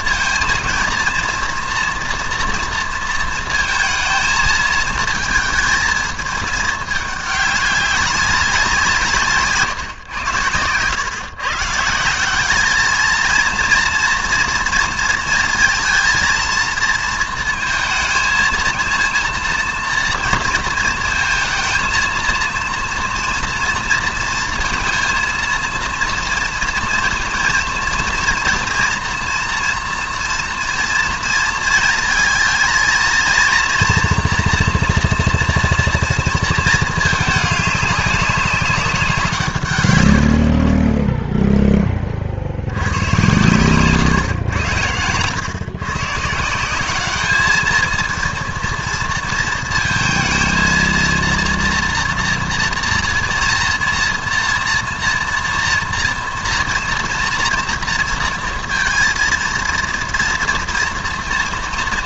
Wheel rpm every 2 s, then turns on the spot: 230, 230, 220, 210, 180, 110, 200, 230, 220, 230, 230, 230, 220, 230, 240, 230, 230, 240, 230, 190, 40, 80, 110, 180, 230, 230, 230, 230, 230, 230, 230.
none